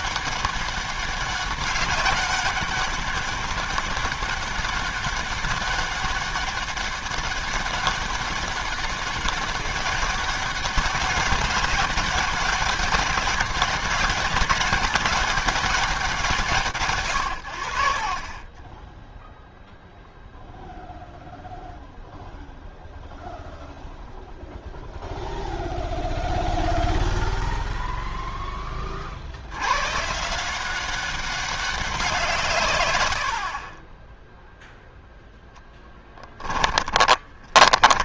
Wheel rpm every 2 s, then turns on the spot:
200, 200, 200, 200, 200, 200, 200, 200, 100, 0, 0, 0, 0, 0, 30, 180, 80, 0, 10.
36-38